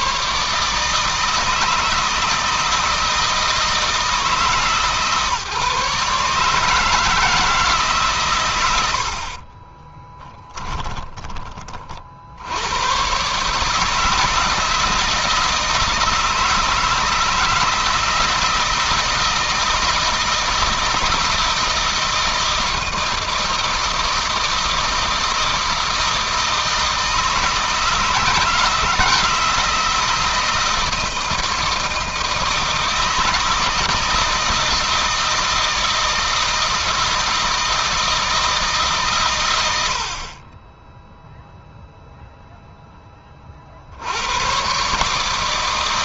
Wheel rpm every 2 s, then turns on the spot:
160, 160, 140, 160, 80, 10, 110, 160, 160, 160, 160, 160, 160, 160, 160, 160, 160, 160, 160, 140, 0, 20, 140.
8-10